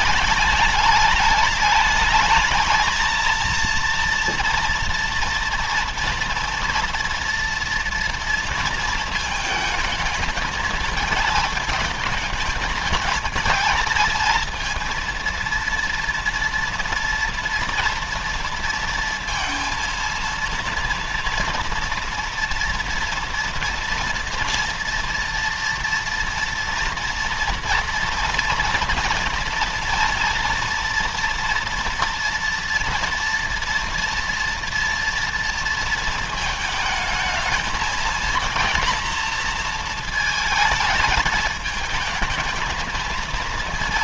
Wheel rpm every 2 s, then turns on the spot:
210, 230, 230, 230, 220, 220, 220, 230, 230, 230, 230, 230, 230, 230, 230, 230, 230, 230, 220, 240, 220, 220.
none